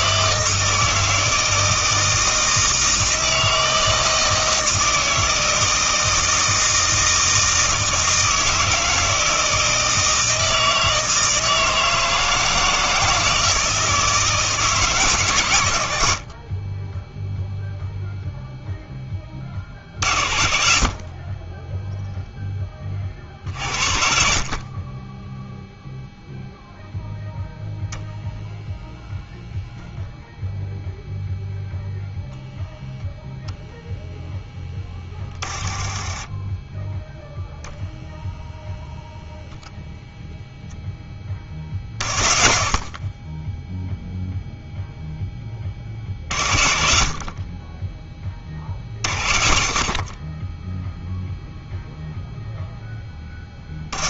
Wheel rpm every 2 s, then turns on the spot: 160, 160, 160, 160, 160, 160, 160, 150, 20, 0, 40, 30, 30, 0, 0, 0, 0, 10, 10, 0, 10, 50, 0, 40, 40, 0, 0.
none